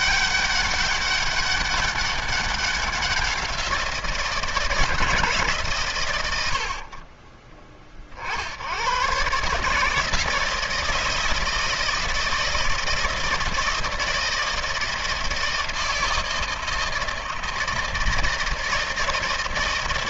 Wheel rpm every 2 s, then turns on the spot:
200, 190, 170, 70, 60, 160, 160, 160, 160, 160.
none